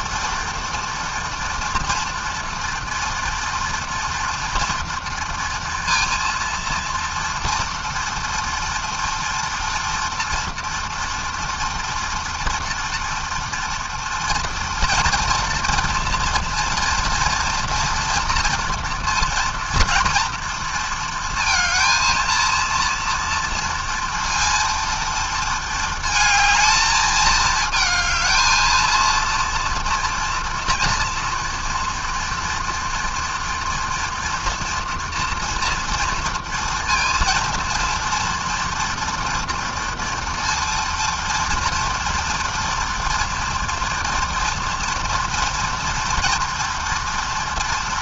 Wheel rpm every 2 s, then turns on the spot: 230, 230, 230, 230, 230, 230, 240, 230, 230, 230, 230, 230, 230, 220, 230, 230, 230, 240, 230, 230, 230, 230, 230, 230.
none